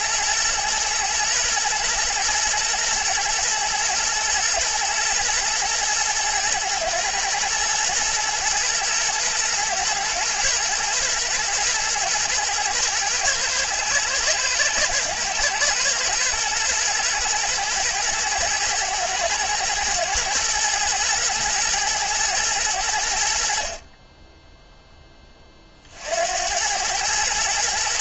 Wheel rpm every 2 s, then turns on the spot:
120, 110, 110, 110, 110, 120, 110, 120, 110, 110, 120, 80, 10, 100.
none